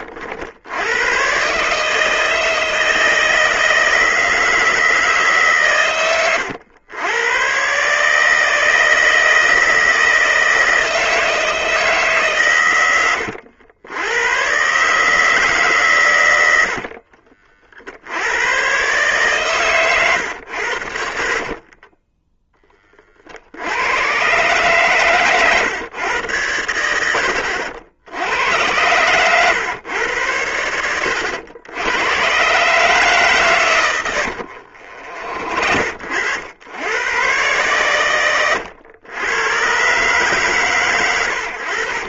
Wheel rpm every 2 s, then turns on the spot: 110, 160, 160, 100, 160, 160, 90, 150, 50, 130, 70, 40, 130, 80, 100, 80, 140, 50, 100, 100, 110.
16-18 34-36